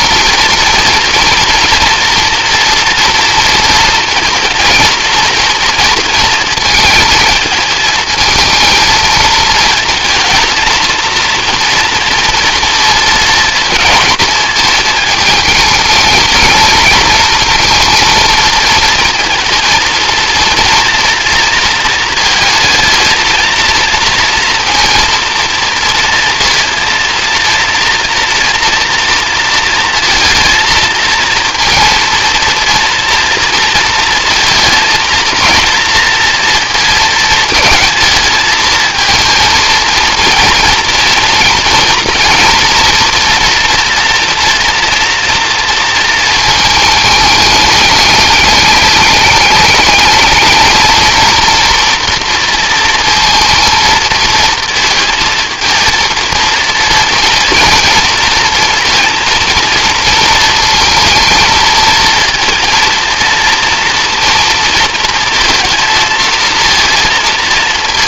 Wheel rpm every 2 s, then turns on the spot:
230, 230, 220, 230, 220, 230, 230, 220, 220, 230, 240, 220, 230, 230, 230, 220, 230, 230, 230, 220, 220, 240, 230, 220, 210, 220, 230, 220, 230, 230, 230, 230, 230, 230.
none